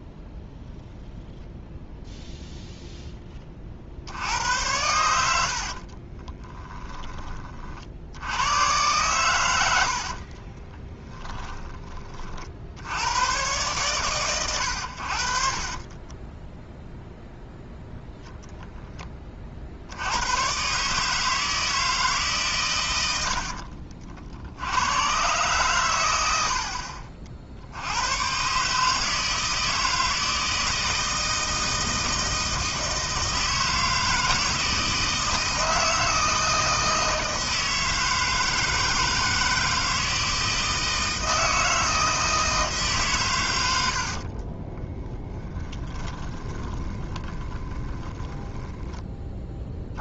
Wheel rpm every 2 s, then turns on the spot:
0, 0, 90, 20, 120, 30, 70, 90, 0, 10, 140, 120, 80, 60, 150, 160, 160, 160, 160, 160, 160, 150, 30, 20, 10.
6-8 10-12 44-48